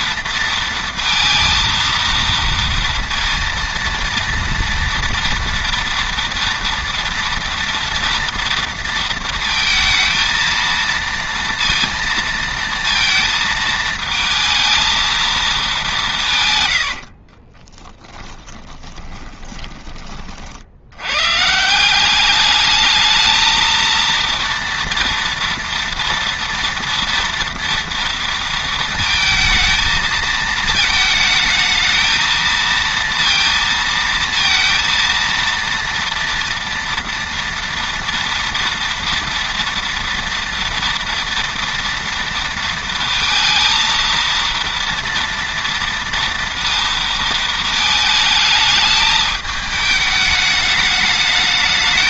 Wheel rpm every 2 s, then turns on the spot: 230, 230, 230, 230, 230, 230, 230, 220, 110, 10, 60, 210, 230, 230, 230, 220, 230, 230, 230, 230, 230, 230, 230, 230, 210, 210.
16-20